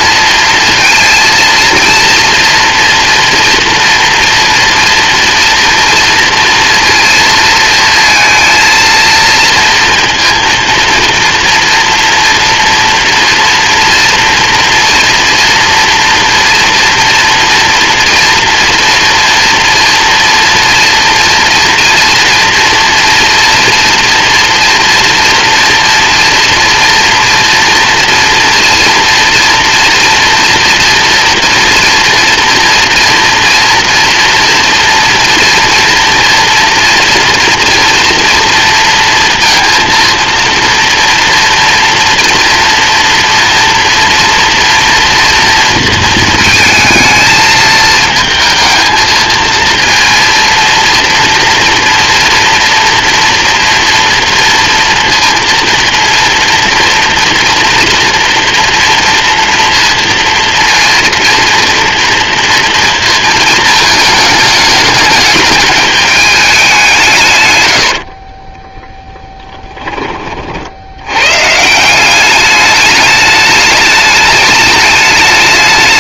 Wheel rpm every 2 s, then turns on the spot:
230, 240, 230, 230, 220, 230, 240, 230, 230, 230, 230, 240, 230, 230, 230, 230, 230, 230, 230, 230, 240, 230, 230, 220, 220, 230, 230, 230, 230, 230, 230, 230, 210, 170, 20, 100, 210, 210.
68-70